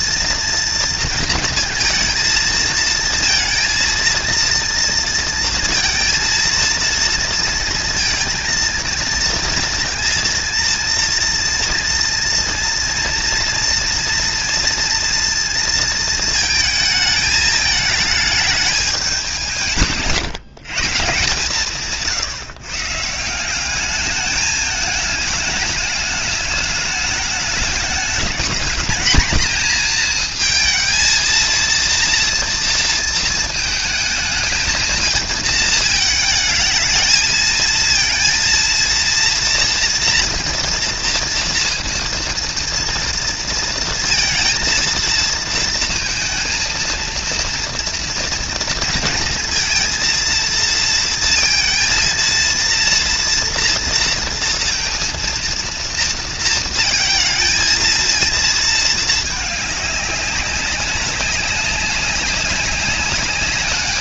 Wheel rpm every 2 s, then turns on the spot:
230, 230, 230, 230, 230, 230, 230, 230, 220, 210, 150, 150, 220, 210, 230, 220, 230, 220, 220, 230, 230, 230, 230, 230, 230, 230, 230, 230, 230, 220, 190, 200.
none